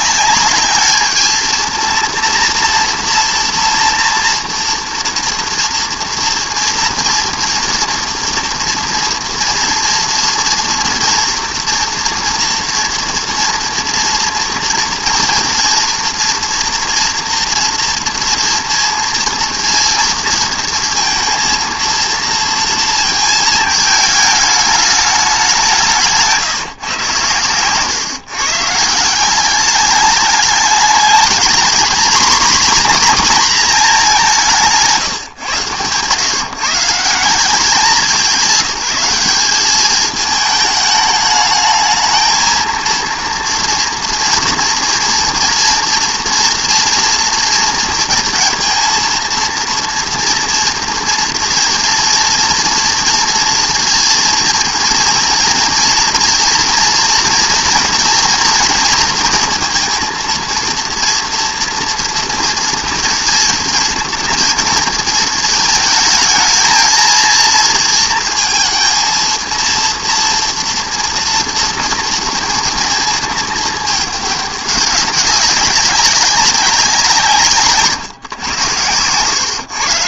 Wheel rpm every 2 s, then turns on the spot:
210, 240, 230, 230, 230, 230, 230, 230, 230, 230, 230, 220, 210, 140, 160, 220, 250, 150, 140, 190, 210, 230, 230, 230, 230, 230, 230, 230, 230, 230, 230, 230, 230, 230, 230, 230, 230, 200, 180, 100.
none